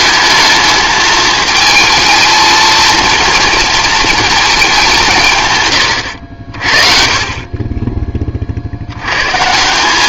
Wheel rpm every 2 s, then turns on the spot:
220, 230, 210, 50, 60.
none